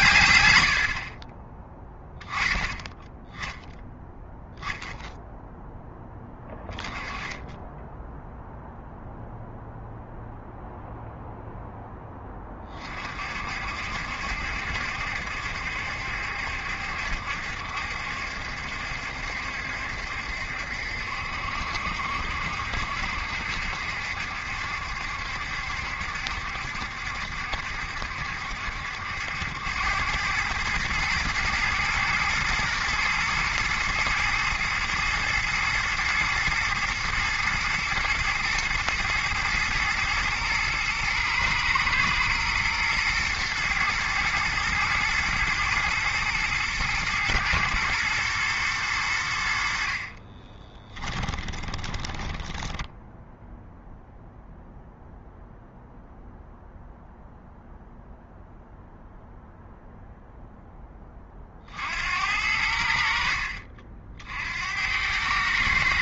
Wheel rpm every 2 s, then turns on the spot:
80, 10, 0, 20, 0, 0, 30, 70, 70, 70, 70, 60, 70, 70, 70, 110, 110, 110, 110, 120, 120, 120, 120, 120, 110, 20, 10, 0, 0, 0, 0, 70, 80.
50-54